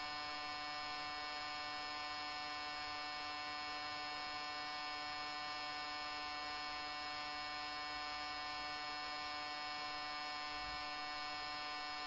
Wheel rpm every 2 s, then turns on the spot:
0, 0, 0, 0, 0, 0.
none